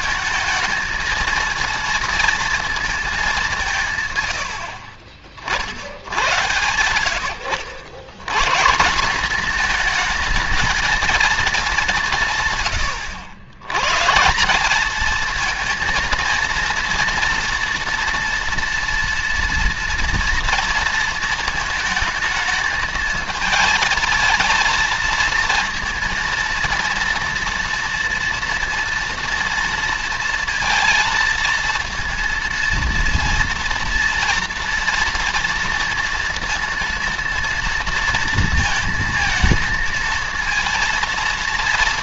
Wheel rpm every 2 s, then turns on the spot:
220, 230, 80, 100, 160, 230, 110, 210, 230, 240, 230, 220, 230, 230, 230, 230, 230, 240, 230, 230, 230.
none